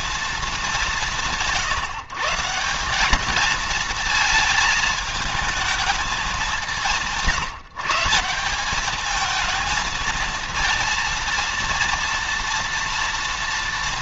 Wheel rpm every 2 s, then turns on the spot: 190, 180, 220, 190, 200, 230, 230.
none